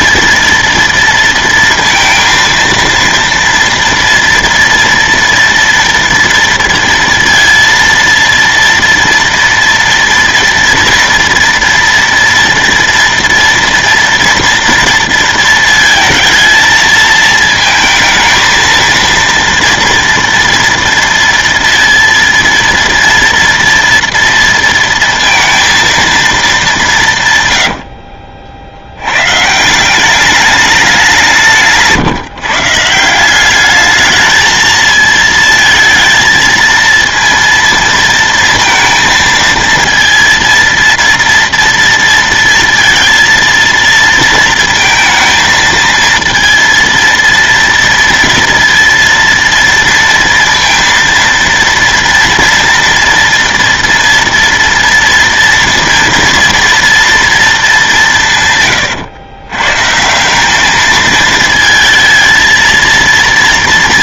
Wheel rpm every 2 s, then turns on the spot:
230, 230, 230, 230, 230, 240, 230, 230, 220, 220, 230, 230, 230, 190, 80, 200, 150, 220, 230, 230, 230, 230, 230, 230, 230, 230, 230, 230, 230, 130, 210, 230.
none